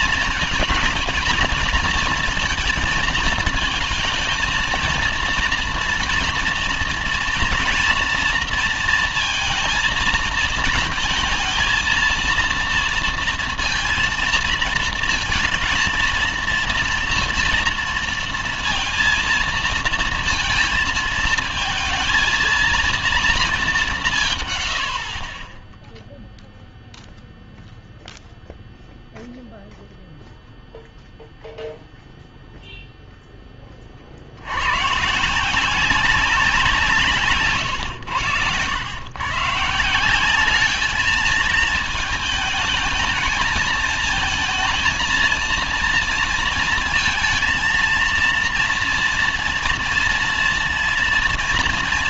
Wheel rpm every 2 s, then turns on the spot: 230, 220, 230, 230, 230, 230, 230, 230, 230, 230, 230, 230, 140, 0, 0, 0, 0, 90, 190, 110, 190, 220, 230, 230, 230, 230.
none